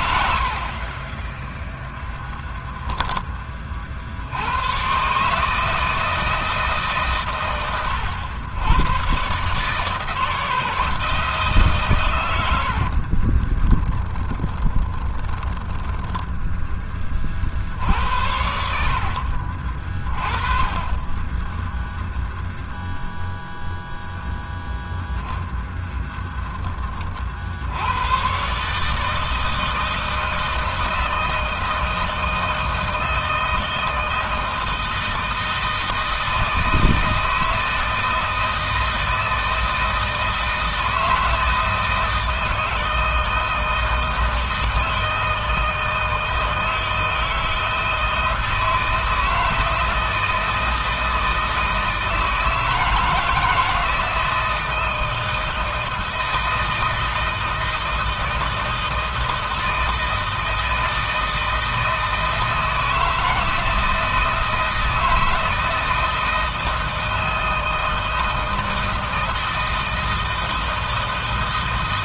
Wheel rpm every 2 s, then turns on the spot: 40, 20, 120, 140, 120, 160, 60, 20, 20, 60, 20, 0, 0, 30, 150, 160, 160, 160, 160, 160, 160, 160, 160, 160, 160, 160, 160, 160, 160, 160, 160, 160, 160, 160, 160, 160.
2-4 12-16 20-22